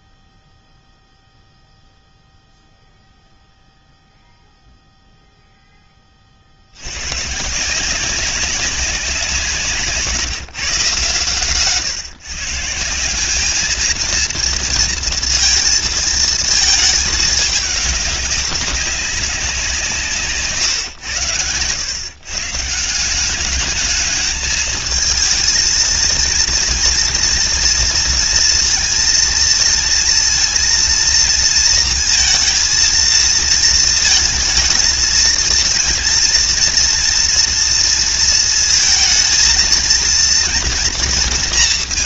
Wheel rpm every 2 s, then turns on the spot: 0, 0, 0, 110, 190, 150, 190, 230, 220, 190, 110, 170, 220, 240, 230, 230, 230, 230, 230, 220, 230.
none